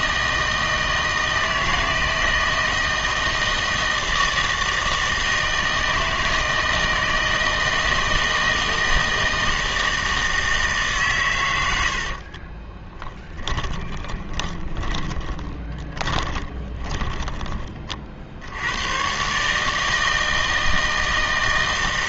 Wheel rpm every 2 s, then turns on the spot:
160, 160, 160, 160, 160, 150, 20, 20, 20, 100, 160.
12-18